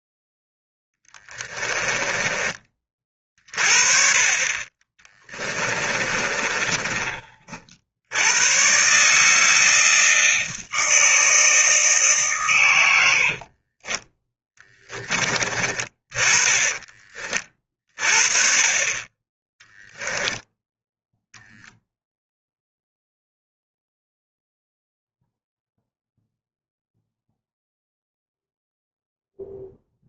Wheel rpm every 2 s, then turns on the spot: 0, 30, 30, 30, 130, 160, 110, 20, 20, 30, 0, 0, 0, 0, 0.
6-8